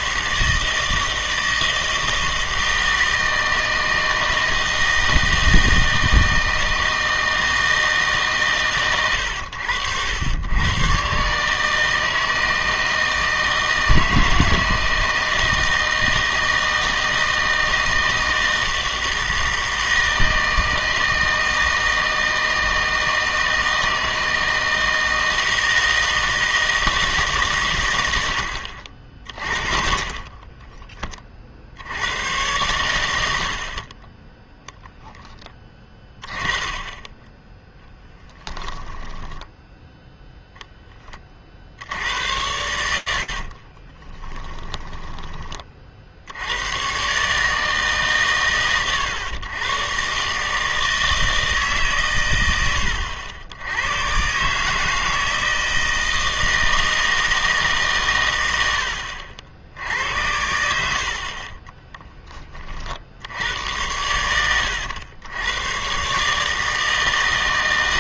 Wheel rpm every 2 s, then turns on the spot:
160, 160, 160, 160, 120, 120, 160, 160, 160, 160, 160, 160, 160, 160, 60, 20, 100, 10, 20, 10, 10, 80, 10, 110, 110, 160, 100, 150, 160, 90, 80, 40, 100, 160.
30-32 38-40 44-46